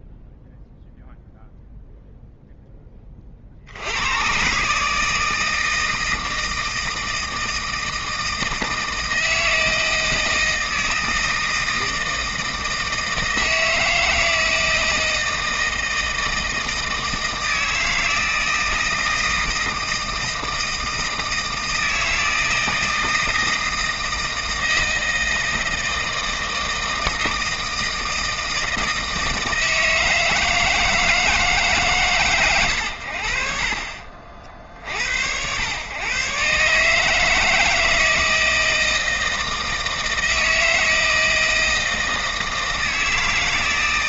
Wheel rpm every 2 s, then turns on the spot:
0, 0, 110, 160, 160, 160, 160, 160, 160, 160, 160, 160, 160, 160, 160, 160, 110, 50, 140, 160, 160, 160.
none